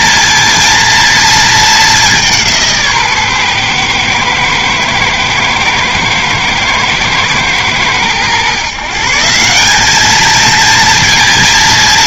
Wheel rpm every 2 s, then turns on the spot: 230, 150, 110, 110, 150, 230.
none